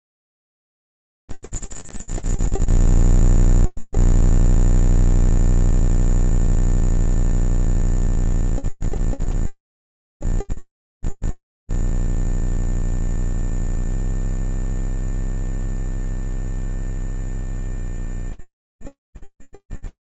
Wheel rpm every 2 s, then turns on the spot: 0, 0, 0, 0, 0, 0, 0, 0, 0, 0.
none